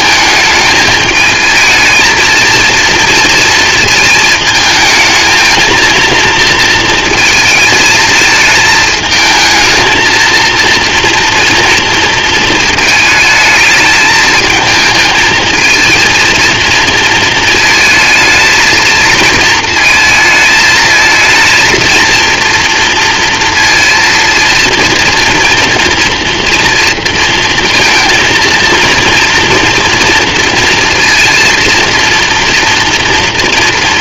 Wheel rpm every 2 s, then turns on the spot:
220, 230, 220, 230, 220, 230, 220, 220, 230, 230, 220, 230, 230, 230, 230, 230, 240.
none